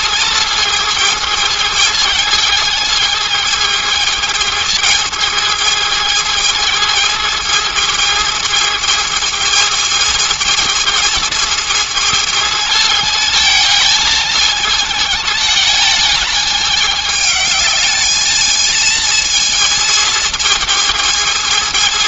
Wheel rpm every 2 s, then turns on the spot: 220, 220, 220, 220, 220, 220, 220, 220, 220, 220, 220.
none